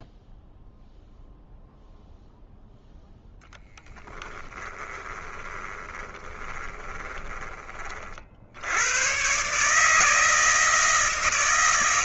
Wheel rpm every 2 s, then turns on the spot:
0, 0, 20, 20, 90, 160.
4-8